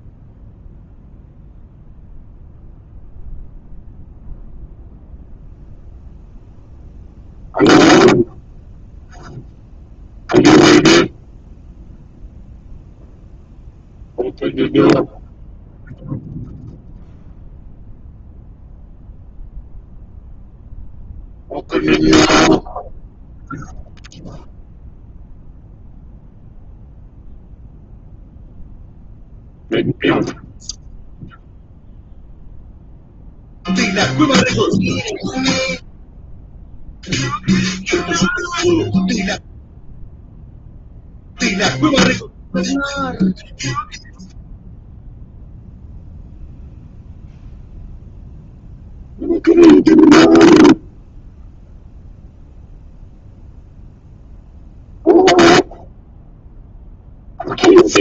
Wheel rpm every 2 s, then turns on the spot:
0, 0, 0, 0, 0, 0, 0, 0, 0, 0, 0, 0, 0, 0, 0, 0, 0, 0, 0, 0, 0, 0, 0, 0, 0, 0, 0, 0, 0.
none